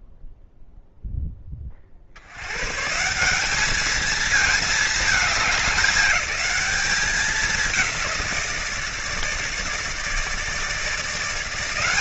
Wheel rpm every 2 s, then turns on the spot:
0, 100, 220, 210, 170, 160.
none